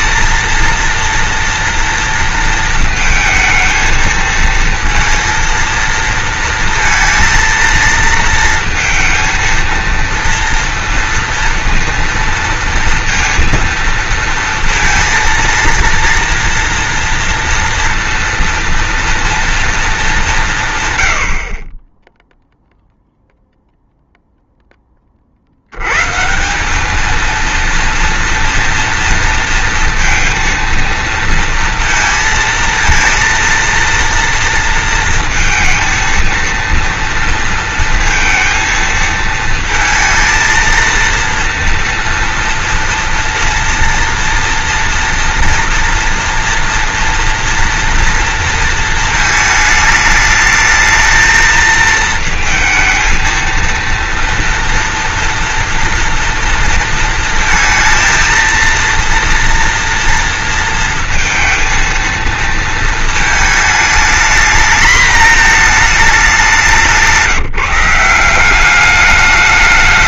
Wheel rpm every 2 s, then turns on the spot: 230, 230, 220, 230, 230, 230, 230, 230, 230, 230, 160, 0, 0, 170, 230, 230, 230, 230, 230, 230, 230, 230, 230, 230, 230, 220, 220, 230, 230, 230, 230, 230, 220, 200, 190.
none